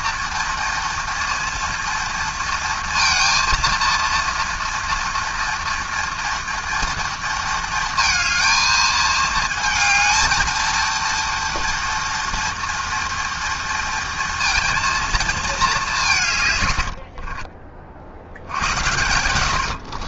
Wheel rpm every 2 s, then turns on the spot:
230, 230, 230, 230, 220, 230, 240, 230, 80, 90.
16-20